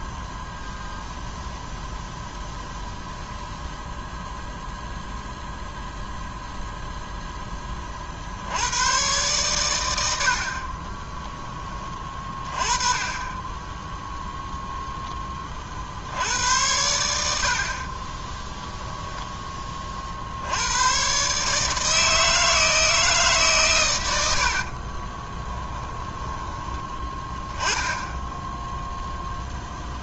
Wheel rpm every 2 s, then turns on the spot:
0, 0, 0, 0, 80, 60, 20, 0, 90, 10, 80, 160, 60, 10, 0.
18-20 24-28